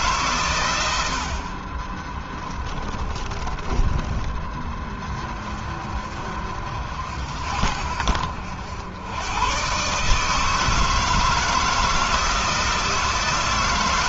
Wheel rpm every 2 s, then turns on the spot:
90, 20, 30, 60, 100, 160, 160.
2-4